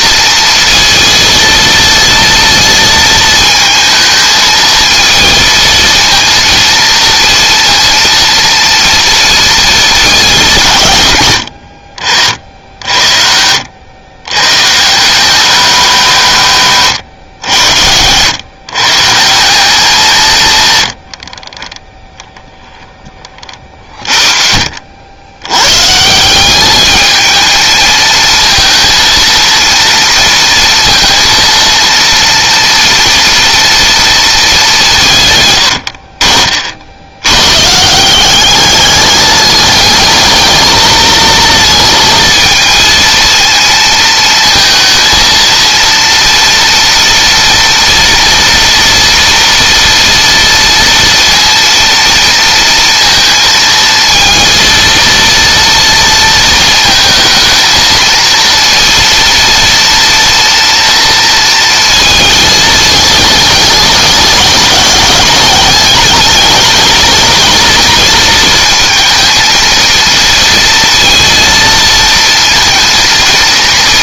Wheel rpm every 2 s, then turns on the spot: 230, 220, 230, 230, 230, 110, 70, 170, 150, 150, 100, 10, 60, 210, 230, 230, 230, 160, 70, 210, 220, 230, 230, 230, 230, 230, 230, 230, 220, 230, 230, 210, 200, 220, 220, 230, 230.
20-22